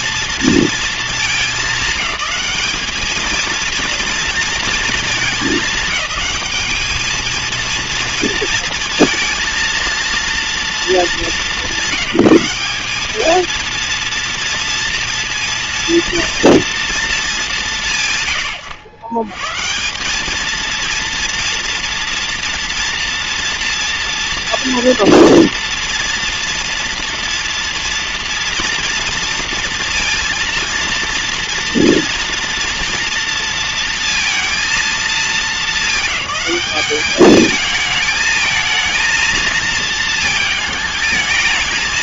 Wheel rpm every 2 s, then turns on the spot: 230, 220, 220, 220, 230, 220, 200, 230, 230, 110, 230, 230, 230, 240, 230, 230, 230, 220, 200, 230, 220.
none